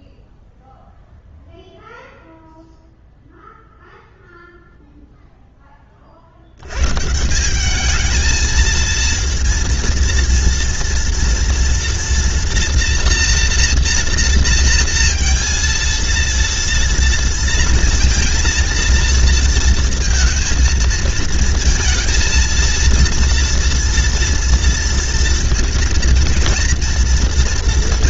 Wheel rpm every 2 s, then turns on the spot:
0, 0, 0, 50, 220, 230, 230, 230, 230, 230, 230, 230, 230, 230.
none